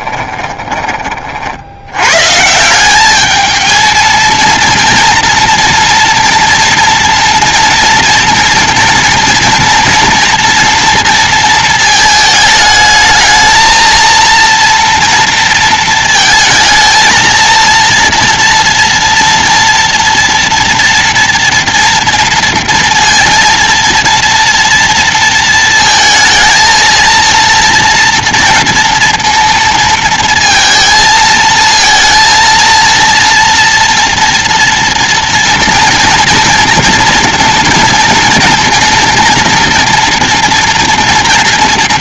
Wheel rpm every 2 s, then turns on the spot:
20, 180, 230, 230, 230, 230, 220, 230, 230, 230, 230, 230, 230, 230, 230, 230, 230, 230, 230, 230, 230.
0-2